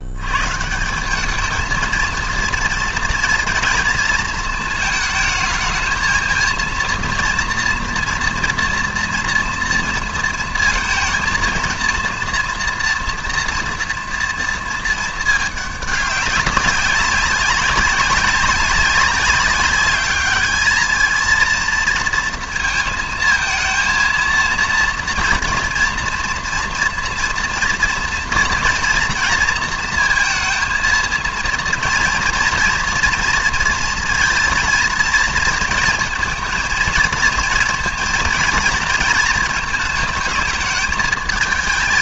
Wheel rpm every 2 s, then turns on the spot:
140, 230, 220, 230, 230, 230, 240, 230, 200, 190, 210, 230, 230, 230, 230, 230, 230, 230, 230, 220, 220.
none